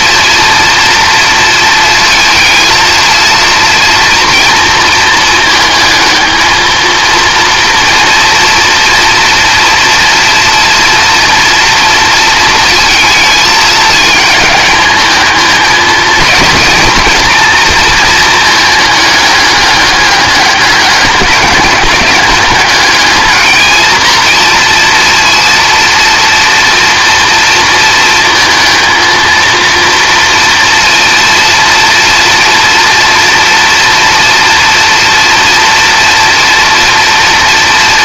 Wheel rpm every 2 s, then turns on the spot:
230, 230, 230, 230, 230, 230, 220, 210, 230, 210, 200, 210, 230, 230, 220, 230, 240, 230, 230.
none